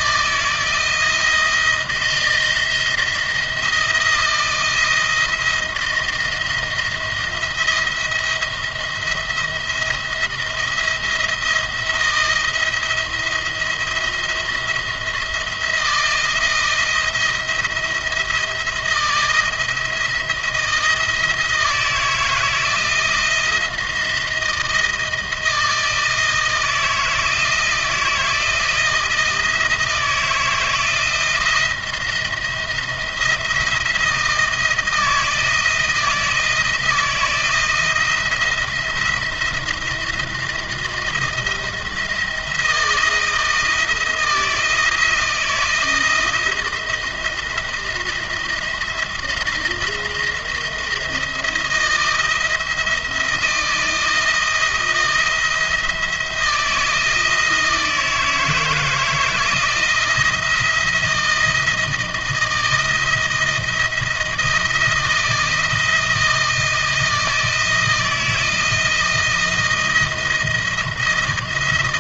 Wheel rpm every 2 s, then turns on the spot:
160, 160, 170, 170, 170, 170, 170, 170, 170, 160, 170, 160, 160, 160, 160, 160, 170, 170, 170, 170, 170, 160, 160, 160, 170, 170, 170, 160, 160, 160, 160, 160, 160, 170, 160, 160.
none